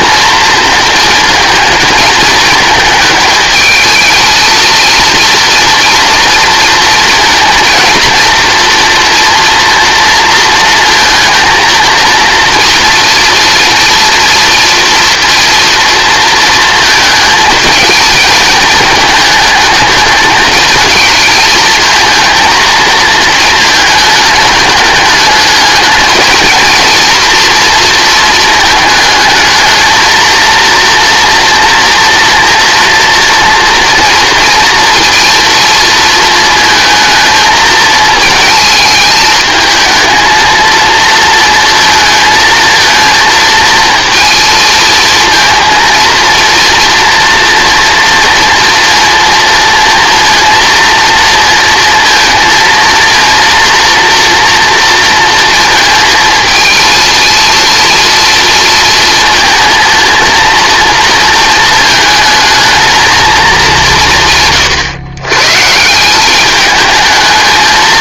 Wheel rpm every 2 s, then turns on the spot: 230, 220, 230, 230, 230, 230, 240, 240, 230, 220, 220, 220, 210, 230, 220, 240, 230, 240, 220, 220, 230, 230, 220, 230, 230, 230, 230, 230, 230, 230, 230, 220, 130, 210.
none